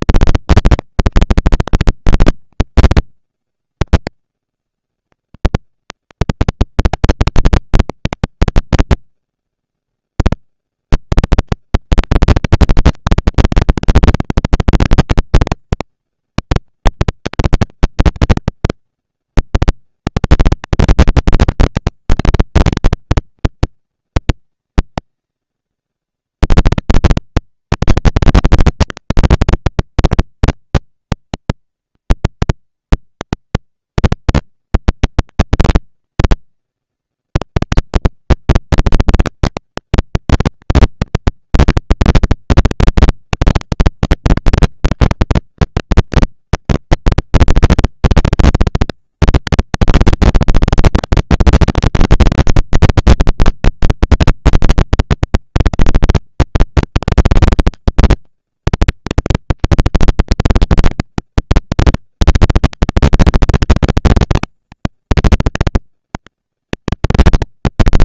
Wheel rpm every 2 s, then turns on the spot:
200, 170, 100, 190, 150, 50, 190, 200, 200, 200, 190, 200, 200, 210, 230, 240, 230, 230, 220, 230, 230, 230, 230, 230, 230, 230, 230, 200, 200, 230, 220, 230, 230, 230.
none